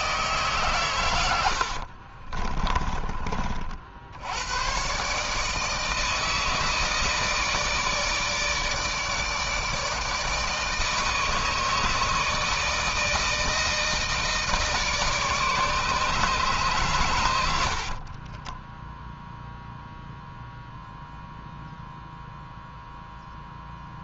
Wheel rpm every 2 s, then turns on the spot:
120, 30, 130, 160, 150, 160, 160, 160, 120, 0, 0, 0.
2-4